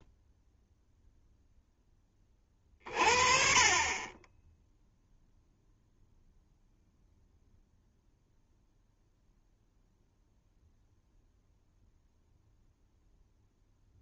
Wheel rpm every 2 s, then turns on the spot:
0, 30, 0, 0, 0, 0, 0.
none